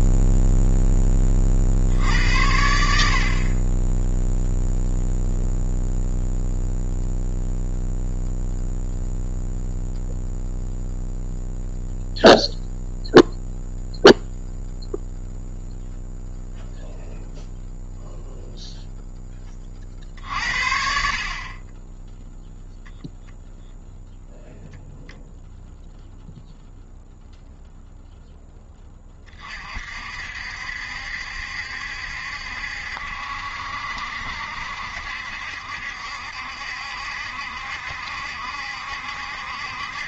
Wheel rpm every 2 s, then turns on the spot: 10, 80, 0, 0, 0, 0, 0, 0, 0, 0, 50, 0, 0, 0, 20, 70, 70, 70, 70, 70.
none